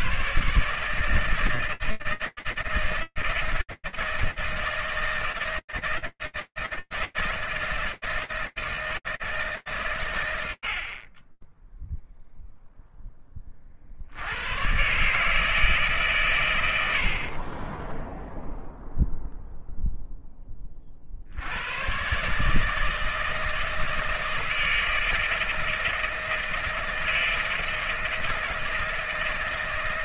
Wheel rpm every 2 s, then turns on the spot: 80, 160, 160, 160, 150, 10, 10, 140, 60, 0, 70, 160, 160, 160, 160.
none